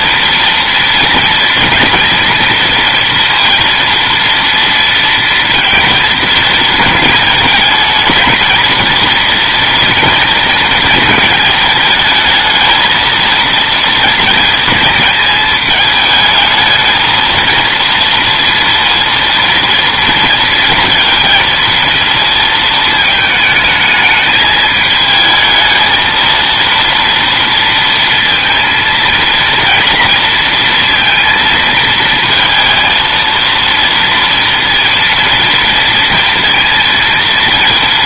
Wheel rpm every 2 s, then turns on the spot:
230, 240, 230, 220, 230, 220, 230, 220, 220, 230, 230, 220, 220, 230, 230, 230, 220, 230, 230.
none